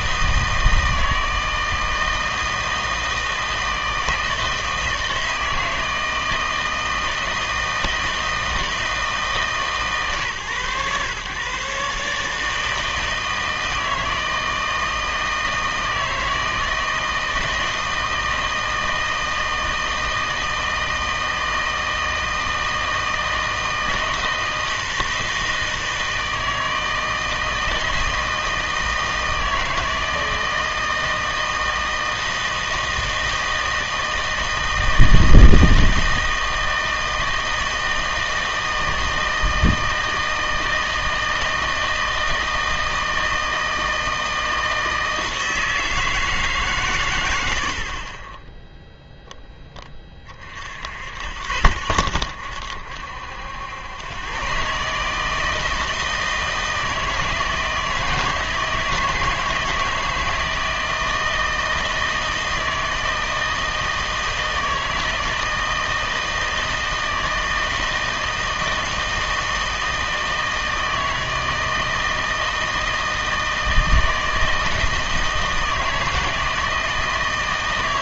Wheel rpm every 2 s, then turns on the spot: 160, 160, 160, 160, 160, 140, 160, 160, 160, 160, 160, 160, 160, 160, 160, 160, 160, 160, 160, 160, 160, 160, 160, 150, 10, 50, 70, 130, 160, 160, 160, 160, 160, 160, 160, 160, 160, 160, 160.
none